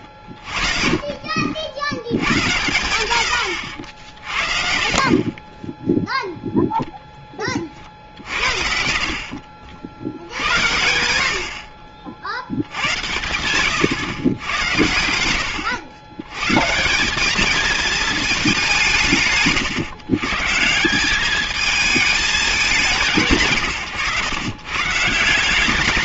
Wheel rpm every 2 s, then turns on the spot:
30, 110, 50, 0, 60, 90, 80, 100, 140, 150, 150, 200, 130.
0-2 4-6